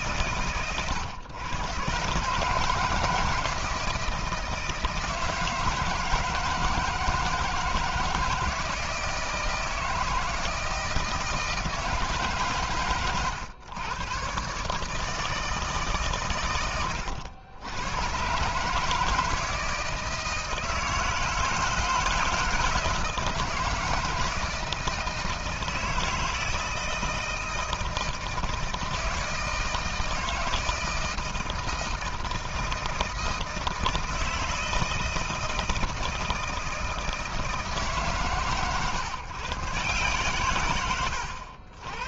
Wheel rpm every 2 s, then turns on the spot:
130, 140, 160, 160, 160, 160, 140, 130, 110, 140, 160, 160, 160, 160, 160, 160, 160, 160, 160, 130, 120.
none